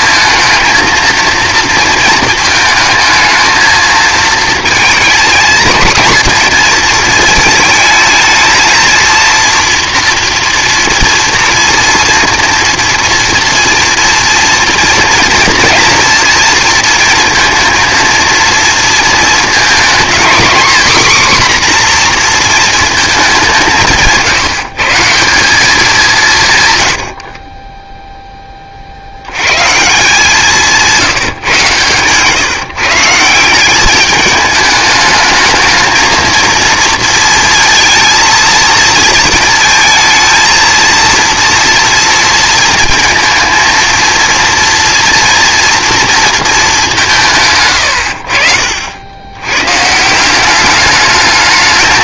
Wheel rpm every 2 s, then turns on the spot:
230, 220, 230, 230, 230, 230, 230, 230, 230, 230, 250, 230, 160, 130, 40, 170, 160, 210, 230, 220, 230, 230, 230, 210, 60, 200.
none